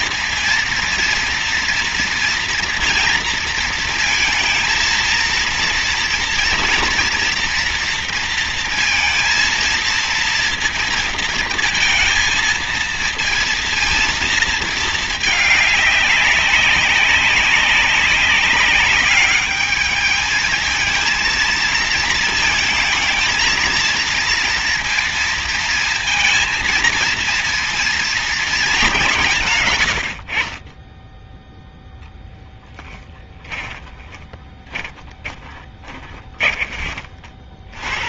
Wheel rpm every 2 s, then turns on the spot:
230, 230, 230, 230, 230, 230, 230, 220, 190, 200, 220, 220, 230, 230, 190, 20, 10, 10, 40.
32-36